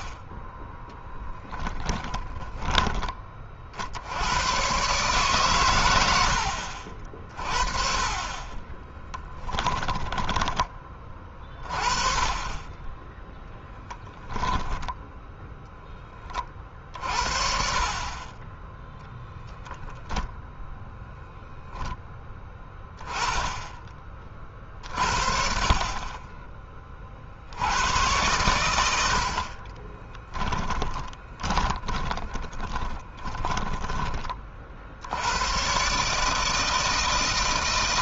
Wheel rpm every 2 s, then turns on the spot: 10, 20, 120, 40, 20, 20, 20, 10, 40, 0, 0, 10, 40, 30, 80, 10, 20, 70, 160.
0-2 8-10 30-34